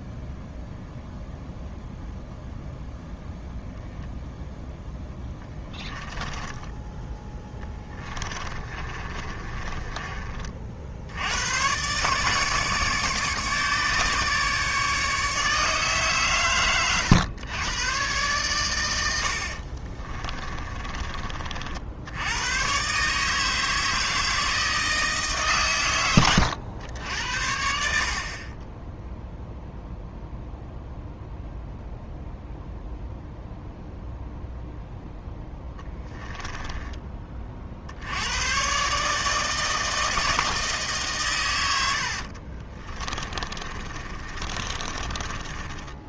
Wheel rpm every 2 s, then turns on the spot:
0, 0, 0, 10, 20, 40, 150, 150, 130, 120, 20, 100, 160, 110, 30, 0, 0, 0, 10, 100, 160, 40, 30.
6-10 20-22 36-38 42-46